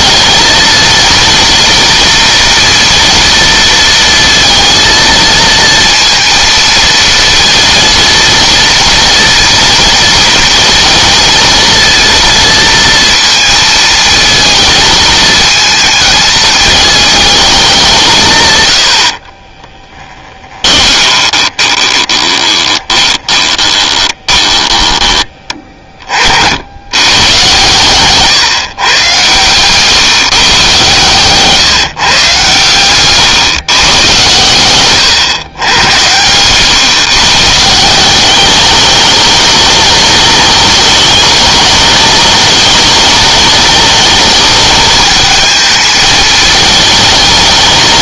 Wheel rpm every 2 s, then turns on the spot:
220, 240, 230, 230, 230, 230, 230, 220, 220, 120, 20, 20, 20, 70, 130, 130, 130, 110, 130, 200, 210, 210, 210, 220.
20-26 34-36